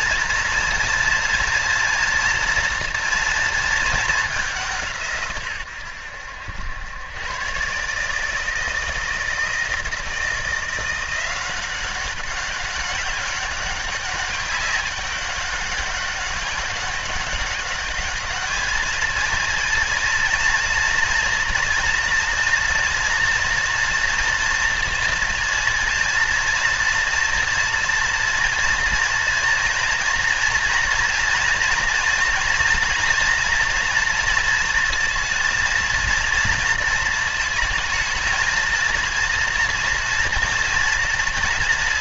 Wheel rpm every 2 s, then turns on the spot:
240, 200, 90, 160, 170, 200, 200, 200, 210, 230, 240, 230, 230, 230, 240, 230, 230, 230, 220, 240, 240.
none